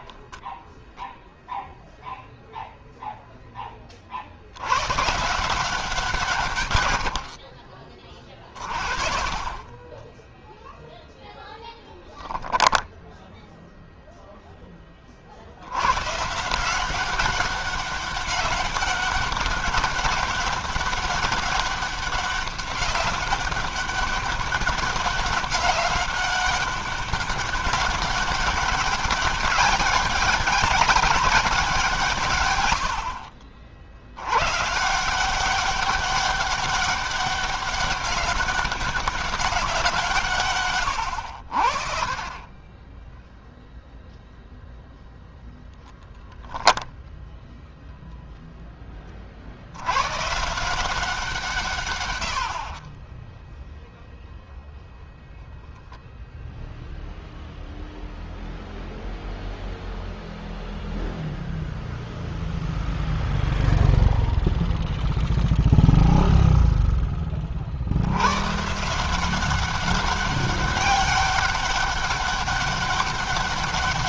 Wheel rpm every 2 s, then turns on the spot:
0, 70, 140, 40, 0, 0, 0, 90, 200, 200, 200, 200, 190, 200, 200, 170, 50, 180, 200, 190, 60, 0, 0, 0, 20, 180, 30, 0, 0, 0, 0, 0, 0, 10, 150, 200, 200.
6-8